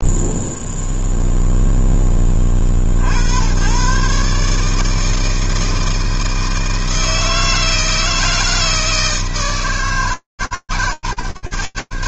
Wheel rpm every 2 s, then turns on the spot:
0, 30, 150, 160, 160, 120.
none